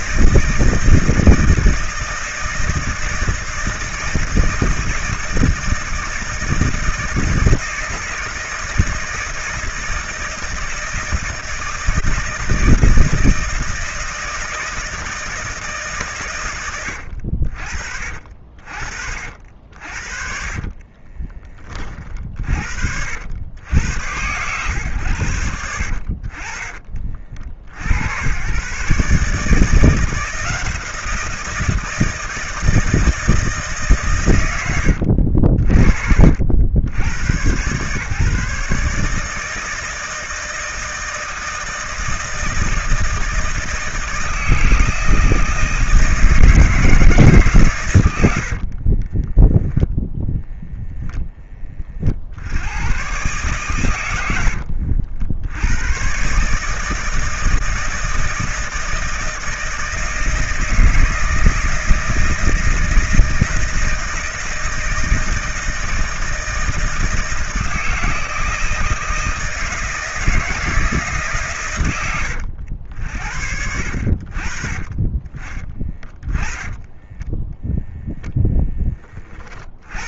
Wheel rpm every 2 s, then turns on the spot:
160, 160, 160, 160, 160, 160, 160, 160, 100, 50, 30, 60, 110, 40, 120, 170, 160, 110, 80, 150, 160, 160, 160, 160, 60, 0, 90, 80, 160, 160, 160, 160, 160, 160, 170, 160, 80, 50, 20, 10.
20-22 48-50 54-56 76-78